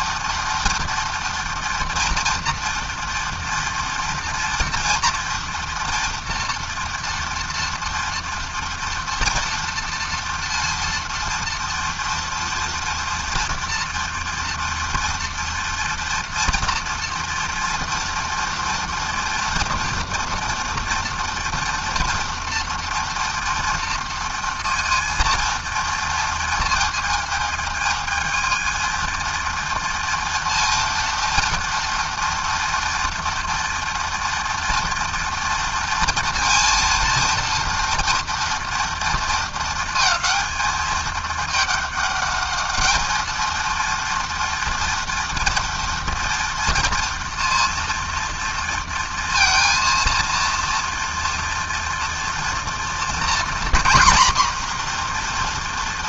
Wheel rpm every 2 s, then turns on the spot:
230, 240, 230, 230, 230, 230, 230, 230, 240, 230, 240, 240, 230, 220, 230, 230, 230, 230, 230, 230, 220, 220, 230, 230, 230, 230, 240, 240.
none